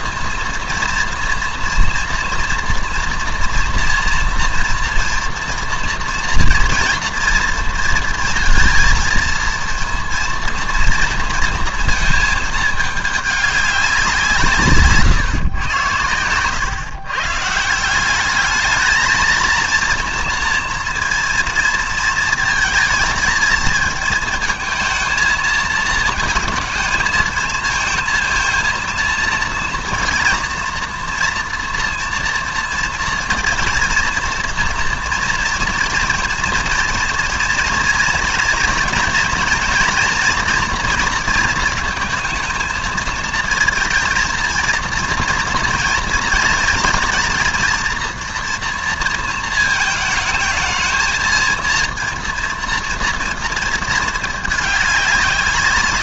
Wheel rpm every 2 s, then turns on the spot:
230, 230, 230, 240, 230, 230, 210, 160, 110, 210, 230, 220, 230, 220, 230, 230, 230, 240, 230, 240, 240, 220, 230, 220, 230, 220, 230, 210.
none